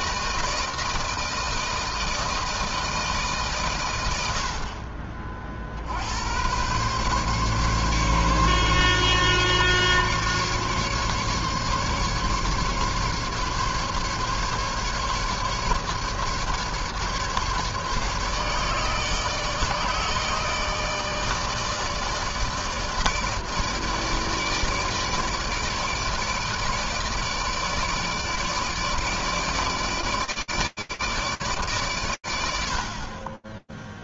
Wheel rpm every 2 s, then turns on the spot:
160, 160, 60, 110, 140, 140, 140, 150, 150, 150, 160, 160, 150, 150, 160, 150, 70.
none